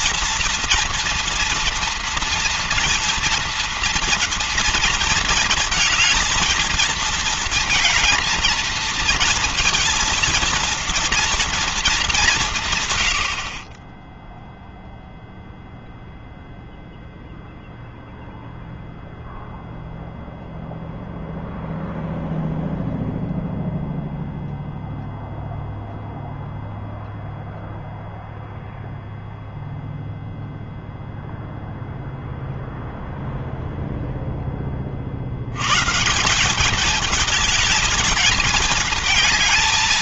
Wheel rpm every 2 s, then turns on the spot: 230, 230, 230, 220, 220, 230, 190, 10, 0, 0, 0, 0, 0, 0, 0, 0, 0, 10, 170, 220.
none